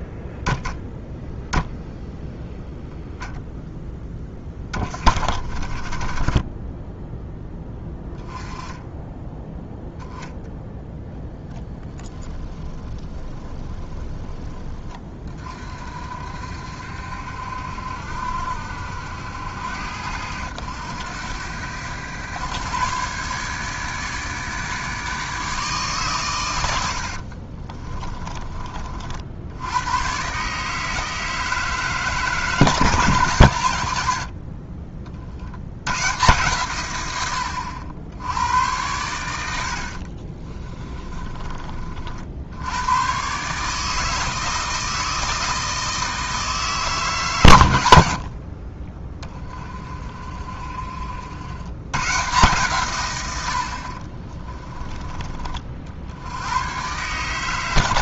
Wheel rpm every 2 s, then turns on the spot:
0, 0, 20, 10, 10, 0, 10, 20, 60, 70, 90, 130, 150, 80, 40, 150, 150, 50, 120, 90, 20, 100, 160, 150, 30, 50, 130, 20, 120.
12-14 40-42 48-50